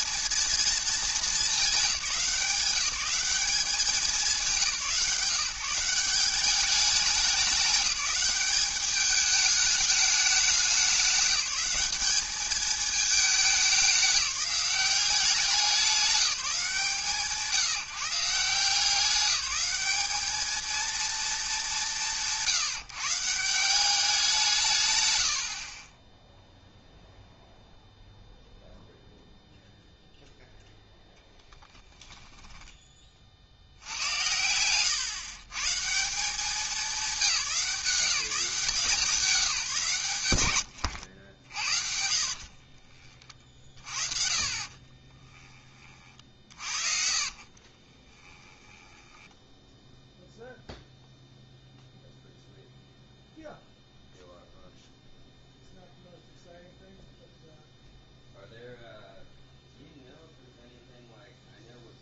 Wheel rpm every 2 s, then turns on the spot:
220, 190, 180, 200, 210, 200, 210, 190, 170, 180, 230, 160, 160, 0, 0, 0, 10, 110, 200, 170, 100, 40, 40, 40, 10, 0, 0, 0, 0, 0, 0.
34-36 40-50